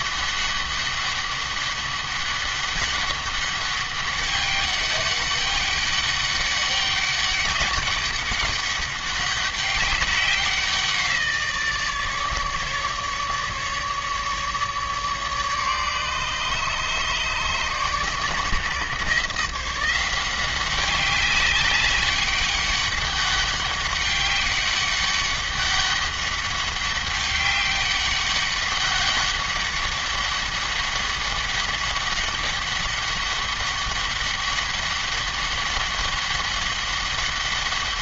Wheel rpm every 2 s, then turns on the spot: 200, 200, 200, 200, 200, 180, 150, 150, 150, 140, 190, 200, 200, 200, 200, 200, 200, 200, 190.
none